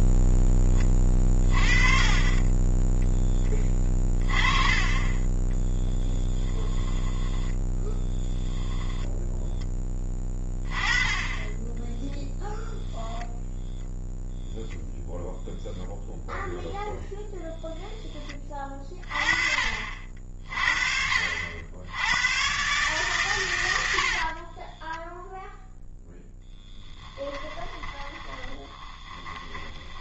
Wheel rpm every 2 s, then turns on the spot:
10, 20, 20, 10, 10, 20, 0, 0, 0, 30, 40, 130, 30, 10, 20.
6-10 24-30